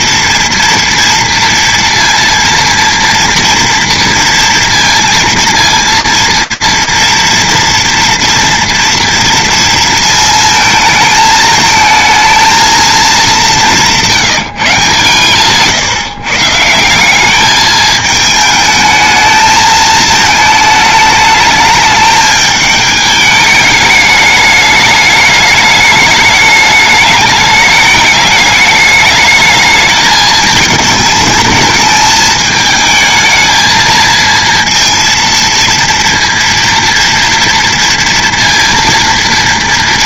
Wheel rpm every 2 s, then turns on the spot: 240, 230, 230, 230, 230, 220, 230, 150, 160, 220, 220, 210, 210, 210, 210, 220, 220, 230, 230, 230.
none